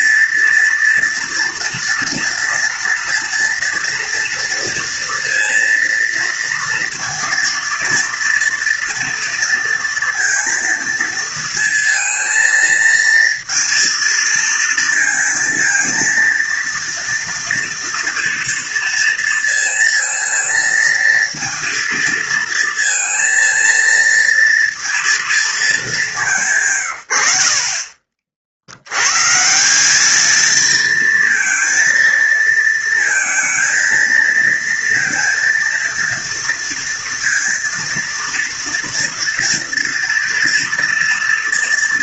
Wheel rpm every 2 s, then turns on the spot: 240, 240, 230, 230, 230, 230, 230, 230, 230, 230, 230, 230, 230, 90, 120, 230, 230, 230, 230, 230, 230.
none